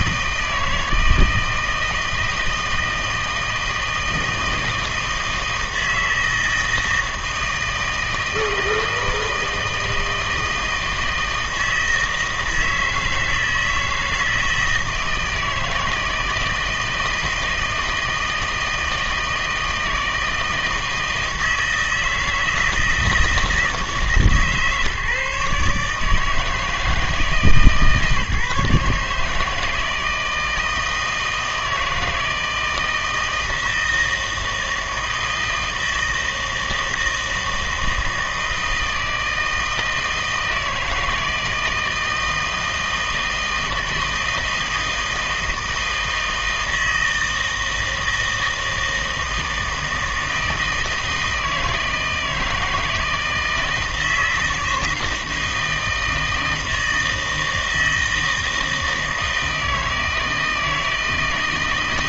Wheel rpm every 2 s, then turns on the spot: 160, 160, 160, 160, 160, 160, 160, 160, 160, 160, 160, 160, 150, 160, 150, 160, 160, 160, 160, 160, 160, 160, 160, 160, 160, 160, 160, 160, 160, 160, 160.
none